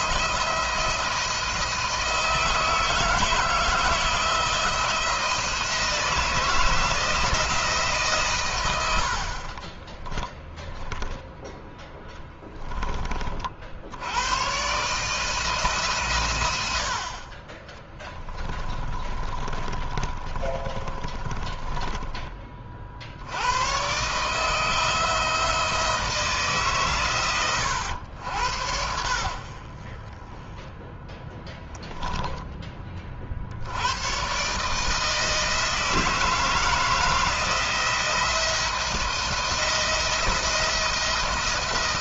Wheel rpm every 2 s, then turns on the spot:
170, 160, 160, 160, 90, 0, 20, 130, 80, 20, 40, 30, 150, 140, 80, 10, 20, 150, 160, 170, 170.
18-22